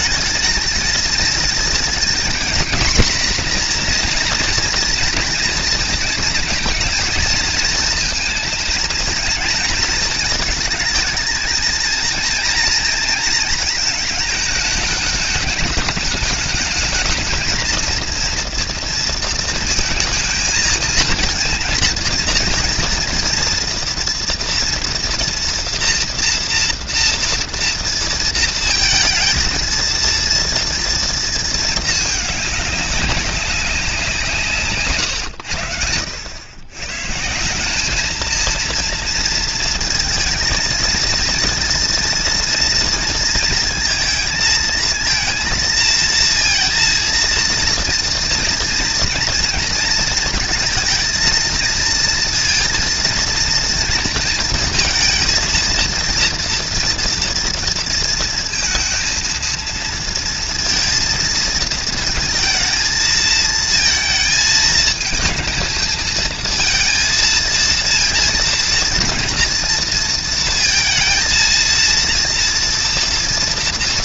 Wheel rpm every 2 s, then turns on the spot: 220, 240, 240, 230, 220, 220, 230, 220, 210, 230, 220, 230, 230, 230, 230, 230, 210, 150, 100, 230, 230, 230, 220, 230, 230, 230, 230, 230, 230, 230, 230, 230, 220, 220, 230, 230, 230.
none